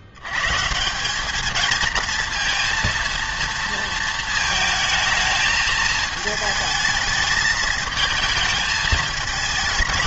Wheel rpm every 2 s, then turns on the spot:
150, 230, 220, 220, 220.
none